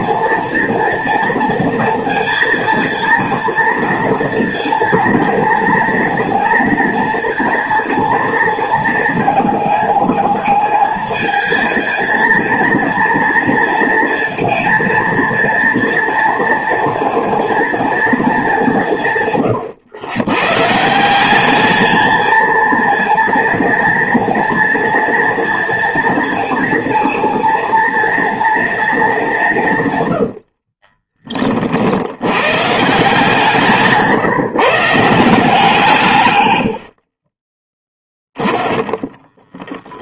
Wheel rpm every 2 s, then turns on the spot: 230, 230, 230, 230, 230, 220, 230, 230, 230, 190, 150, 230, 230, 230, 230, 70, 130, 160, 90, 10.
30-32 38-40